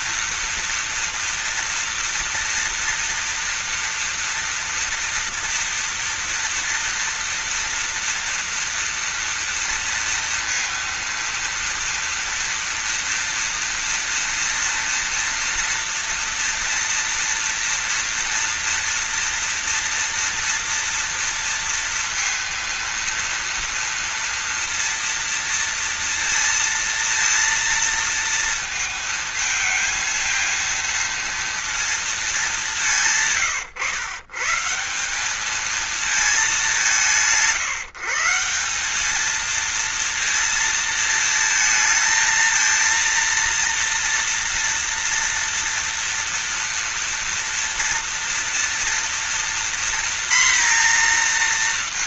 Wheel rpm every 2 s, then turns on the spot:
230, 230, 230, 230, 240, 230, 230, 230, 230, 230, 230, 230, 230, 230, 230, 230, 200, 140, 200, 170, 230, 230, 230, 230, 230, 240.
none